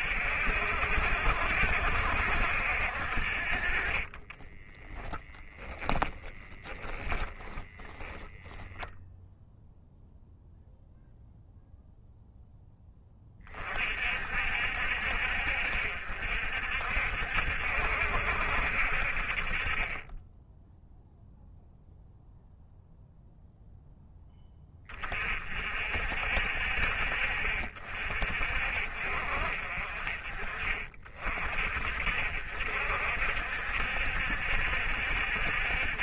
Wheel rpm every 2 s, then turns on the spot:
60, 60, 10, 10, 0, 0, 10, 60, 60, 60, 0, 0, 20, 50, 50, 40, 60, 70.
4-8